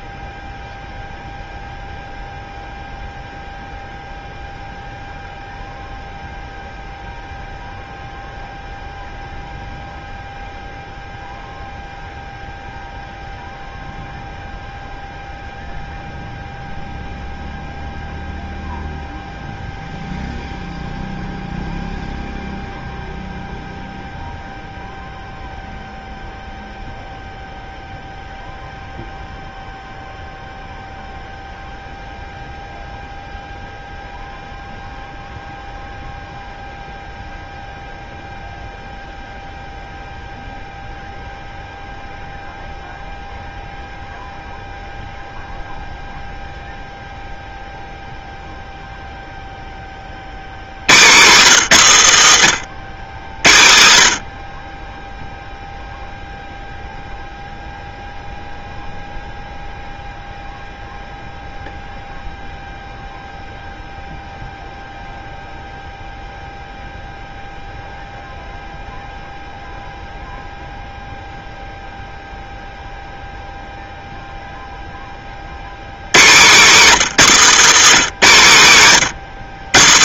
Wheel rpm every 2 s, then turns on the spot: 0, 0, 0, 0, 0, 0, 0, 0, 0, 0, 0, 0, 0, 0, 0, 0, 0, 0, 0, 0, 0, 0, 0, 0, 0, 120, 90, 0, 0, 0, 0, 0, 0, 0, 0, 0, 0, 30, 170, 120.
76-78